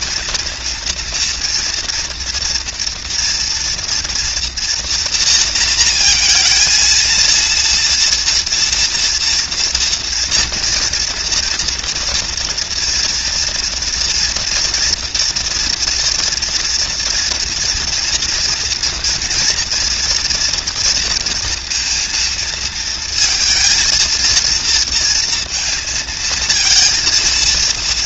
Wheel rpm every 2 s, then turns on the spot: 210, 230, 240, 230, 230, 230, 230, 230, 230, 230, 230, 230, 230, 230.
none